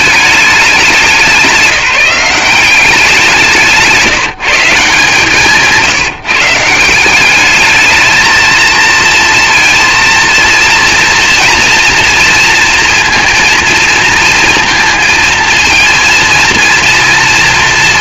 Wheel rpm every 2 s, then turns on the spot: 180, 180, 160, 180, 230, 230, 230, 230, 230.
none